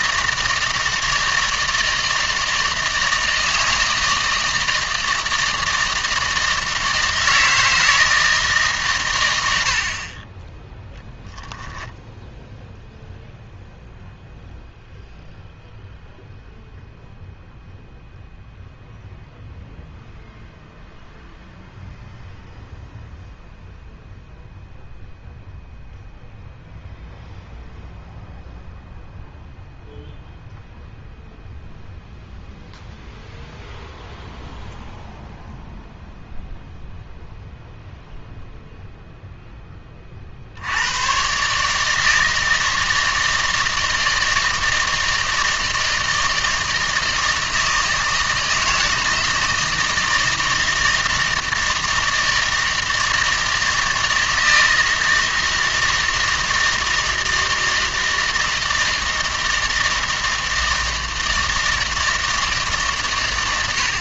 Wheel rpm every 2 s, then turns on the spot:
170, 160, 160, 160, 150, 10, 0, 0, 0, 0, 0, 0, 0, 0, 0, 0, 0, 0, 0, 0, 70, 160, 160, 160, 160, 160, 160, 160, 160, 160, 160, 150.
none